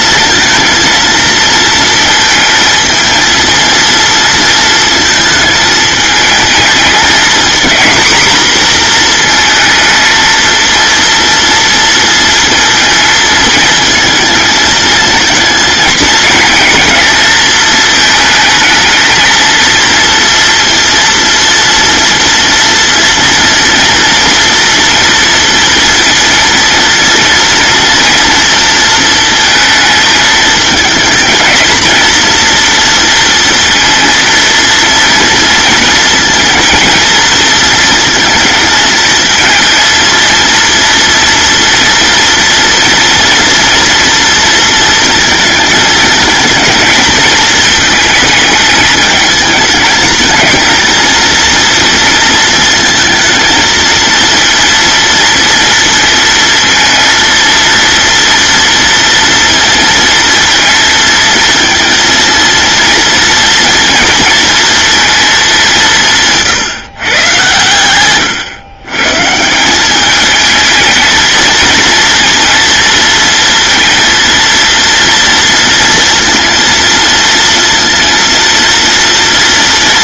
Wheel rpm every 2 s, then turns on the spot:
230, 230, 220, 220, 230, 230, 230, 220, 220, 220, 230, 240, 230, 230, 230, 220, 230, 230, 230, 220, 230, 230, 230, 220, 220, 220, 230, 230, 230, 230, 230, 230, 230, 140, 130, 220, 230, 230, 230, 230.
none